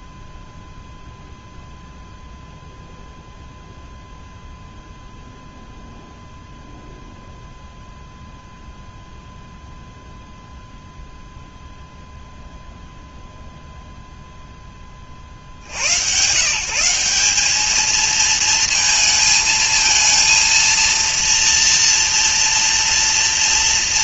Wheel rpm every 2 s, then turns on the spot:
0, 0, 0, 0, 0, 0, 0, 0, 150, 230, 230, 230.
none